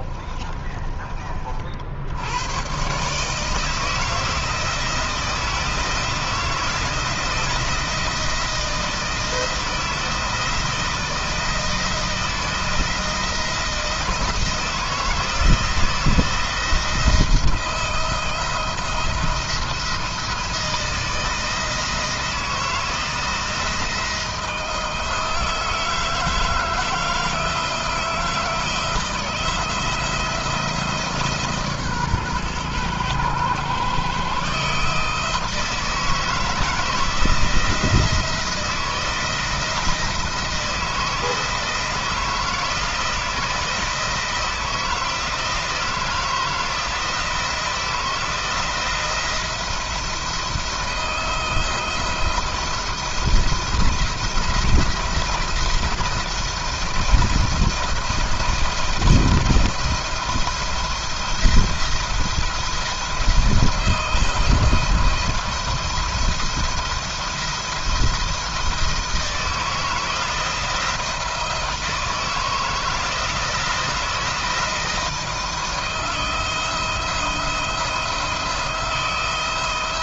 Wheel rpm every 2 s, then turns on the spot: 30, 120, 170, 170, 170, 170, 160, 160, 170, 160, 160, 170, 160, 160, 170, 160, 120, 150, 160, 160, 160, 160, 170, 170, 170, 170, 170, 160, 170, 170, 170, 170, 170, 170, 160, 170, 160, 170, 160, 170.
0-2